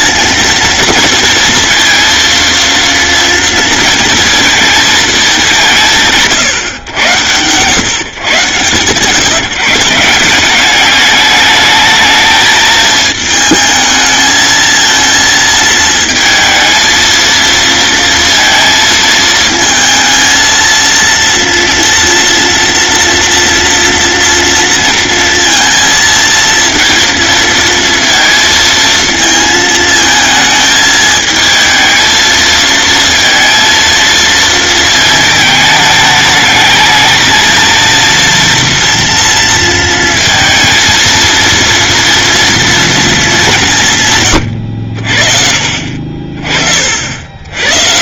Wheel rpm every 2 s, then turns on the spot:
230, 230, 230, 120, 140, 200, 220, 220, 220, 230, 230, 230, 230, 230, 230, 220, 230, 220, 220, 230, 230, 230, 70, 40.
none